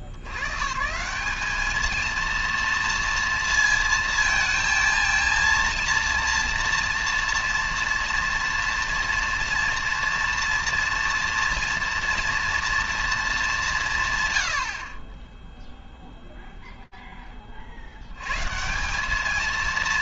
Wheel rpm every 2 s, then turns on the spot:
120, 230, 230, 240, 240, 230, 230, 130, 0, 140.
none